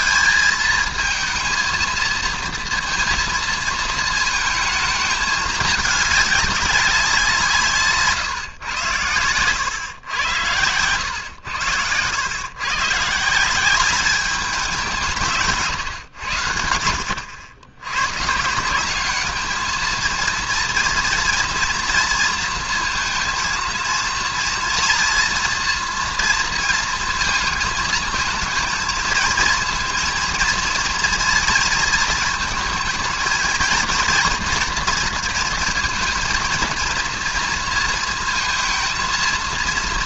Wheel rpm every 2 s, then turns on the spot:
220, 230, 220, 200, 120, 100, 130, 190, 90, 170, 230, 230, 230, 230, 220, 230, 220, 230, 230, 230.
none